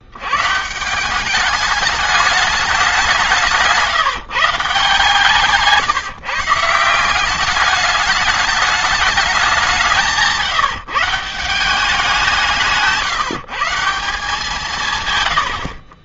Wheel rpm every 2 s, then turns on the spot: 160, 190, 150, 160, 210, 150, 170, 150.
none